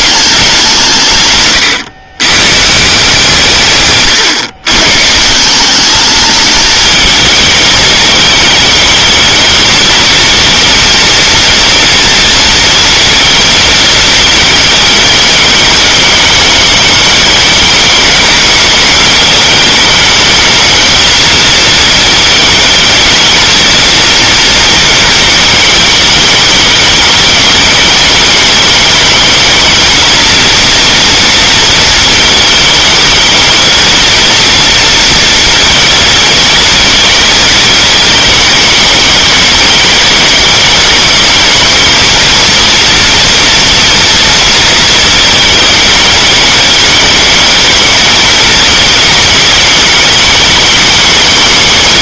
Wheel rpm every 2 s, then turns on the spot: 180, 140, 130, 210, 210, 230, 230, 220, 210, 210, 220, 220, 230, 210, 220, 230, 220, 230, 220, 210, 200, 230, 230, 210, 220, 220.
none